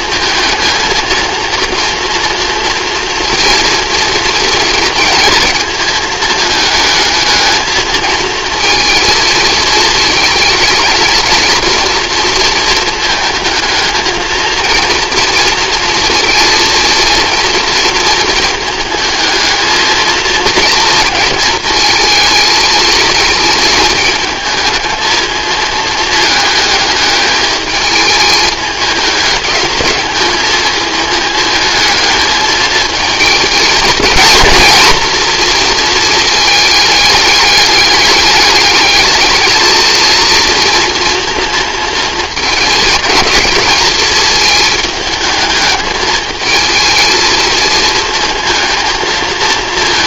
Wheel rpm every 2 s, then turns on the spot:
220, 230, 230, 210, 230, 220, 240, 230, 230, 220, 230, 220, 220, 220, 210, 220, 220, 230, 220, 210, 230, 230, 220, 220, 230.
none